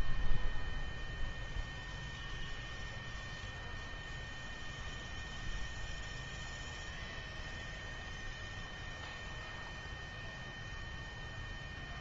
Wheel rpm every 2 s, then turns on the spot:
0, 0, 0, 0, 0, 0.
none